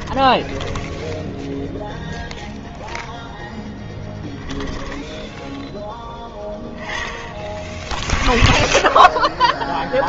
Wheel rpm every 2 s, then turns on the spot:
10, 0, 10, 10, 0.
0-2 4-6